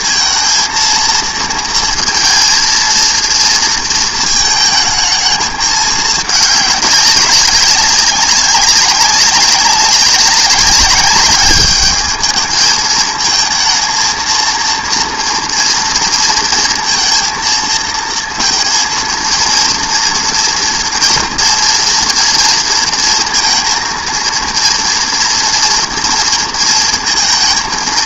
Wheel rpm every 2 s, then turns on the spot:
230, 230, 220, 200, 200, 200, 210, 230, 230, 220, 230, 230, 230, 230.
none